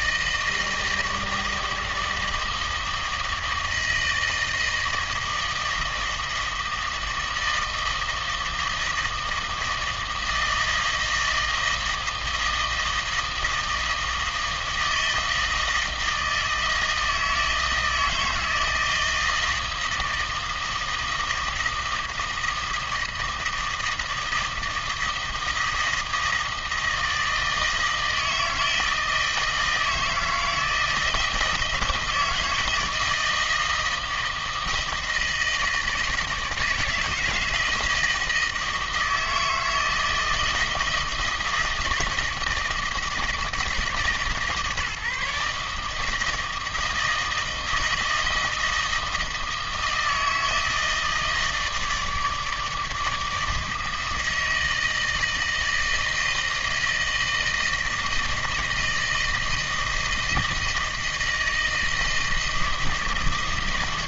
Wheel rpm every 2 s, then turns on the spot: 160, 160, 160, 160, 160, 160, 160, 160, 160, 160, 160, 160, 160, 160, 160, 160, 160, 160, 160, 160, 160, 160, 150, 160, 160, 160, 150, 160, 160, 160, 160, 160.
none